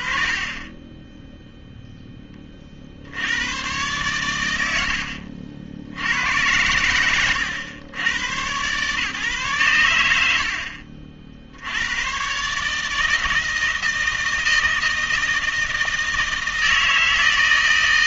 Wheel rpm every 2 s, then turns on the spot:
40, 30, 110, 100, 130, 50, 150, 160, 160.
10-12